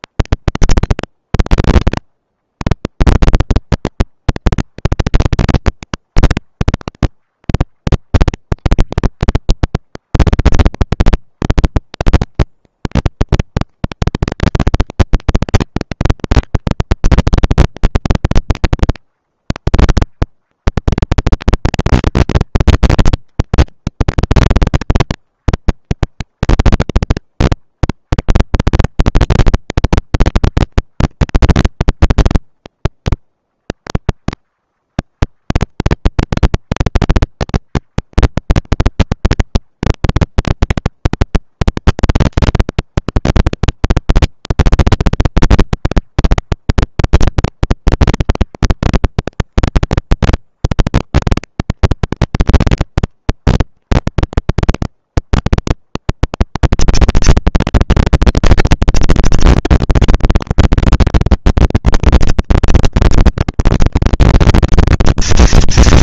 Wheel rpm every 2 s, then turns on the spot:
170, 160, 220, 210, 200, 190, 210, 220, 230, 230, 230, 230, 230, 190, 190, 230, 230, 230, 230, 230, 220, 200, 190, 210, 230, 230, 230, 230, 230, 230, 230, 230, 230.
none